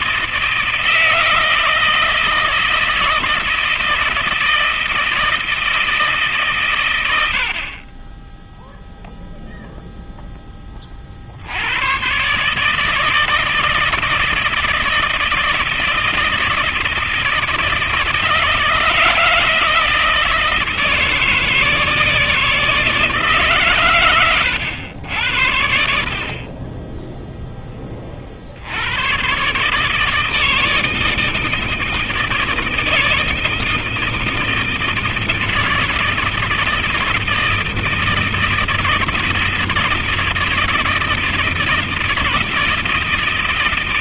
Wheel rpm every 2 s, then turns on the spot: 160, 160, 160, 140, 20, 10, 140, 160, 160, 160, 160, 160, 120, 40, 70, 160, 160, 160, 160, 160, 160, 160.
none